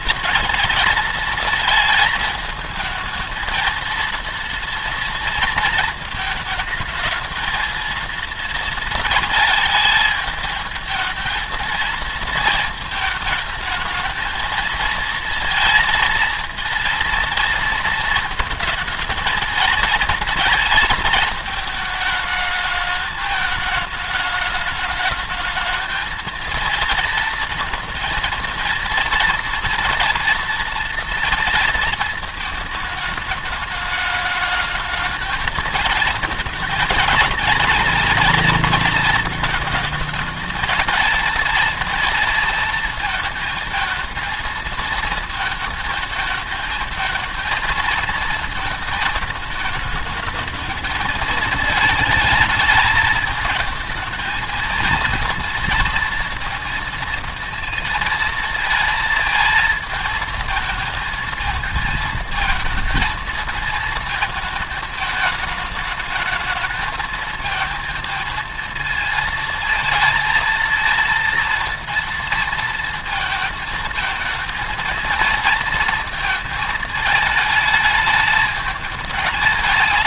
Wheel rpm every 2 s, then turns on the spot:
230, 220, 230, 220, 230, 220, 220, 220, 230, 230, 220, 220, 210, 230, 230, 230, 220, 210, 230, 230, 220, 230, 220, 220, 220, 220, 220, 220, 230, 230, 220, 230, 220, 220, 230, 230, 230, 220, 220, 210.
none